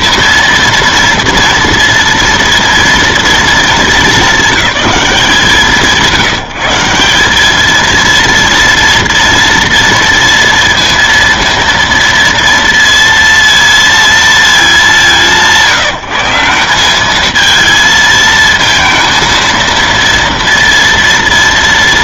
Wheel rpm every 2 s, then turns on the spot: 230, 230, 210, 160, 230, 230, 230, 210, 190, 230, 230.
none